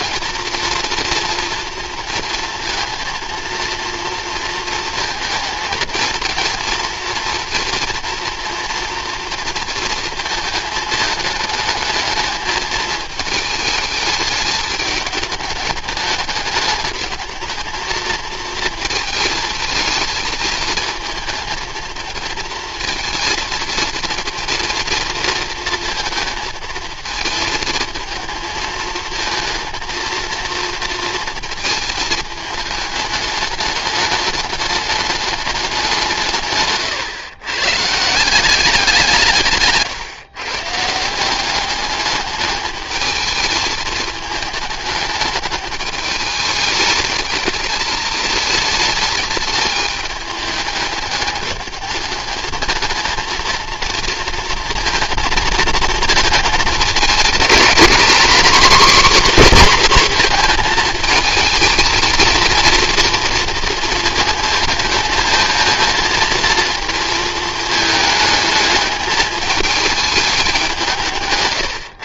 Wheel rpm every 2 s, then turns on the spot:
230, 230, 230, 230, 230, 220, 220, 210, 210, 220, 220, 230, 230, 220, 220, 230, 210, 210, 130, 180, 150, 220, 220, 210, 220, 210, 220, 230, 220, 250, 230, 230, 220, 220, 210, 180.
36-38